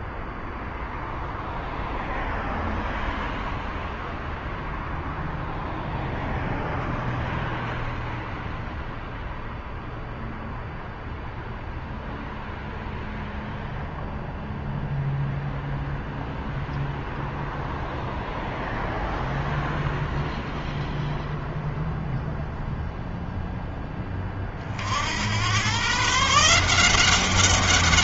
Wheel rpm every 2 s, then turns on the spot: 0, 0, 0, 0, 0, 0, 0, 0, 0, 0, 0, 0, 80, 180.
none